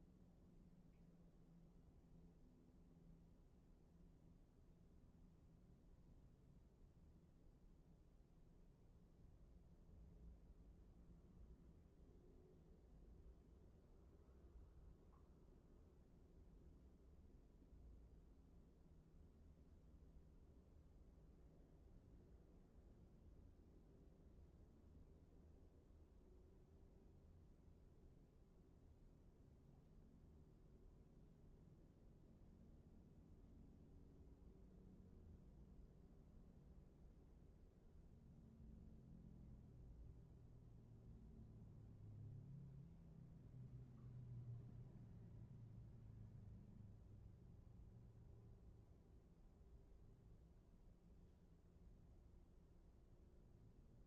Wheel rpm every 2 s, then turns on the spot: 0, 0, 0, 0, 0, 0, 0, 0, 0, 0, 0, 0, 0, 0, 0, 0, 0, 0, 0, 0, 0, 0, 0, 0, 0, 0, 0.
none